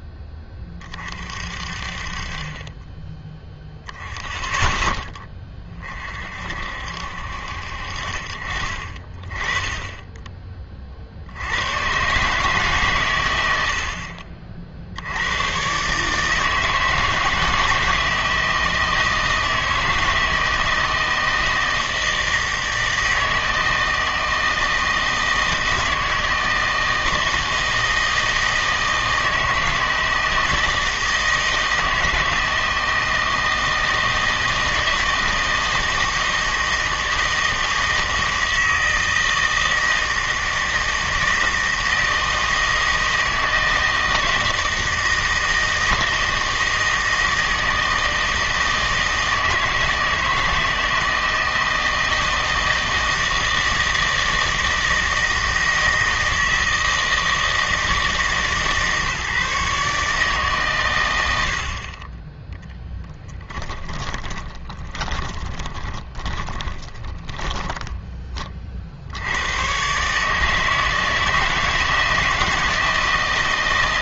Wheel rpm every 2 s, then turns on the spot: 30, 20, 10, 60, 40, 30, 140, 50, 160, 160, 160, 160, 160, 160, 160, 160, 160, 160, 160, 160, 160, 160, 160, 160, 160, 160, 160, 160, 160, 150, 130, 10, 10, 20, 50, 160, 160.
62-68